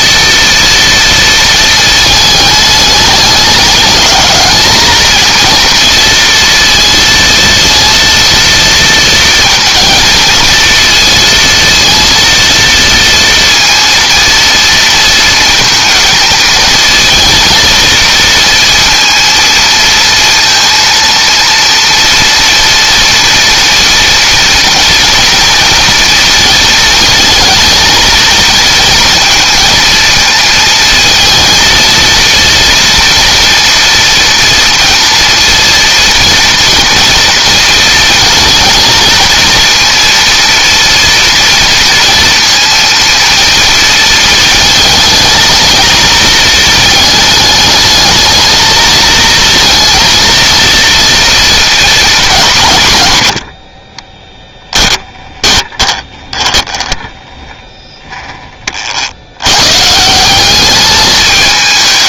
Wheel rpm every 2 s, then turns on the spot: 230, 220, 220, 230, 230, 230, 230, 230, 220, 230, 230, 230, 230, 230, 230, 230, 230, 230, 230, 230, 230, 230, 220, 220, 220, 230, 160, 10, 10, 40, 200.
54-58